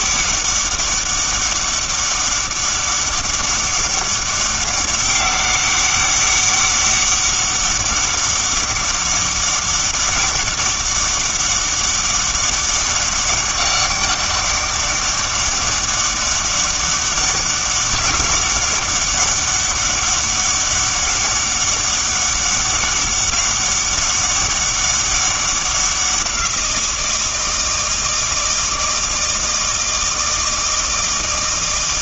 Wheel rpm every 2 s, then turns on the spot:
200, 200, 200, 200, 200, 200, 200, 200, 200, 200, 200, 200, 200, 170, 160, 160.
none